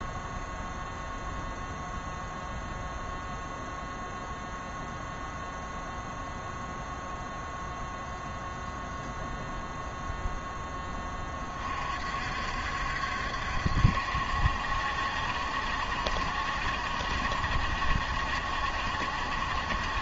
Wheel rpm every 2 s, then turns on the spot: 0, 0, 0, 0, 0, 10, 60, 70, 70, 70.
none